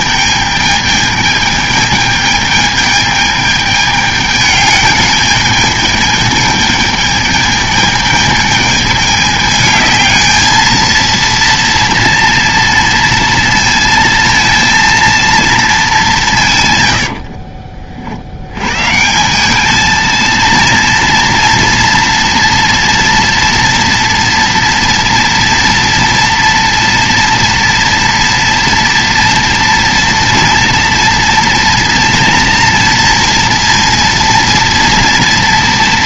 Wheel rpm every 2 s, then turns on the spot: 220, 210, 210, 210, 220, 220, 230, 230, 160, 90, 230, 230, 230, 230, 230, 230, 230, 230.
none